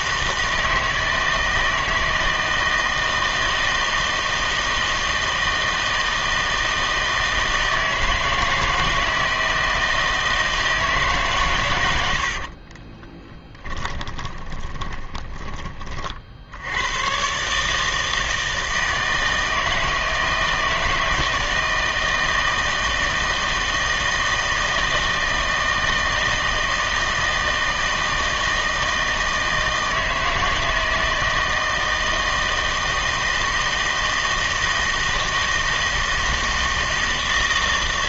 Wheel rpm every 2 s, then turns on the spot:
160, 160, 160, 160, 160, 160, 50, 20, 80, 160, 160, 160, 160, 160, 160, 160, 160, 160, 160.
12-16